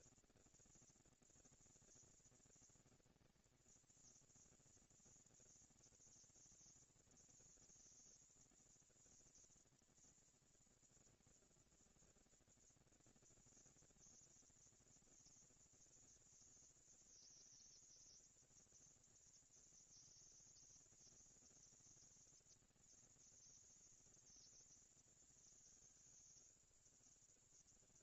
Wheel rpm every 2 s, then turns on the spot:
230, 230, 230, 230, 230, 230, 230, 230, 230, 230, 230, 230, 230, 180.
none